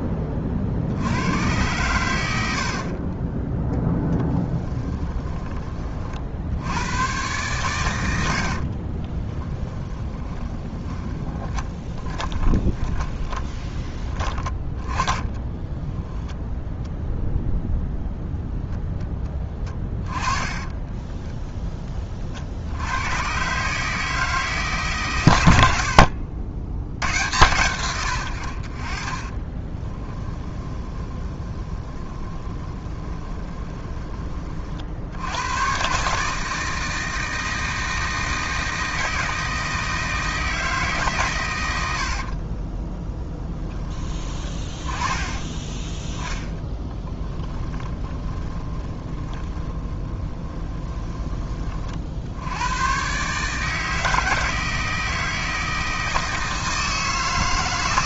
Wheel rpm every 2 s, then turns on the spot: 50, 40, 20, 100, 40, 20, 20, 20, 0, 10, 10, 90, 140, 90, 40, 20, 20, 60, 160, 160, 160, 20, 20, 10, 30, 20, 110, 160, 160.
4-6 8-16 20-22 30-34 46-52